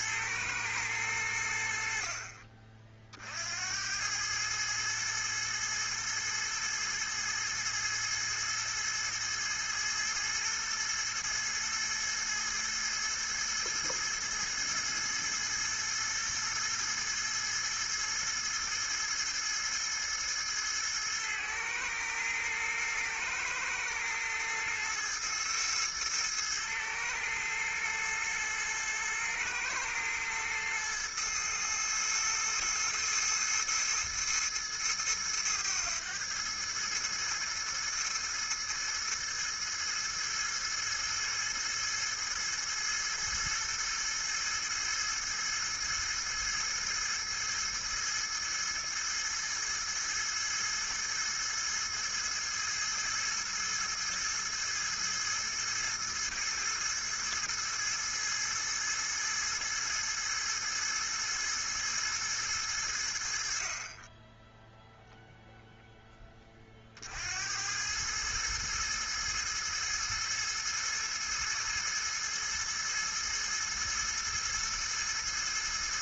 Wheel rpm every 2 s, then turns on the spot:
110, 40, 110, 110, 110, 110, 110, 110, 110, 110, 110, 110, 110, 110, 110, 110, 110, 110, 110, 110, 110, 110, 110, 110, 110, 110, 110, 110, 110, 110, 110, 110, 10, 30, 110, 110, 110, 110.
none